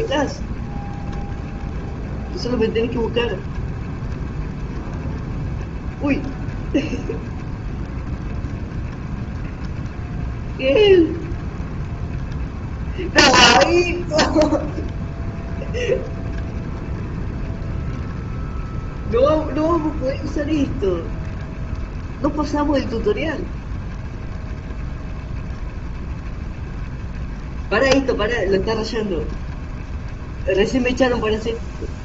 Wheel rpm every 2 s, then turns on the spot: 30, 30, 30, 30, 30, 20, 20, 20, 20, 20, 30, 30, 20, 20, 20, 20.
0-32